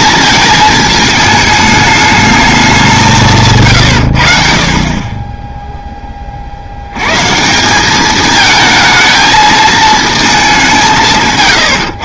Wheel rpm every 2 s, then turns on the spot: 220, 190, 40, 80, 220, 180.
none